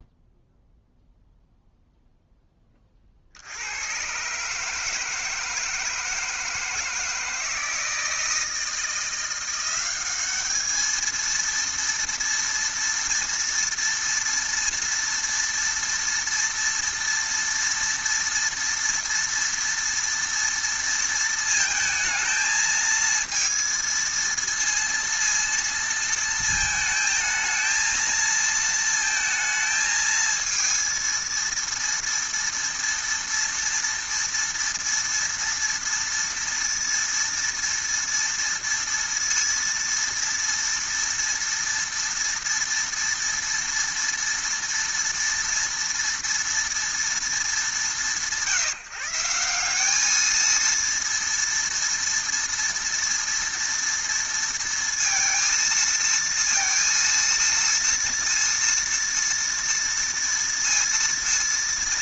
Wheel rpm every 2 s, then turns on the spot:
0, 10, 140, 160, 160, 210, 230, 230, 230, 230, 230, 220, 230, 220, 230, 230, 230, 230, 230, 230, 230, 230, 230, 230, 150, 220, 230, 230, 230, 230, 230.
none